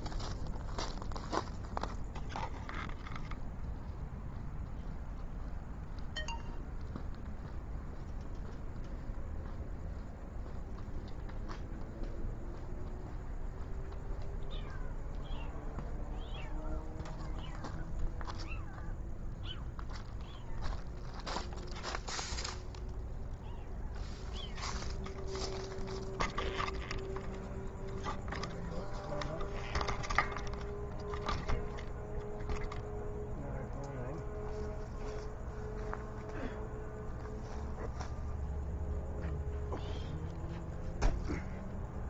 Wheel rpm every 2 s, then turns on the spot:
0, 0, 0, 0, 0, 0, 0, 0, 0, 0, 0, 0, 0, 0, 0, 0, 0, 0, 0, 0, 0.
none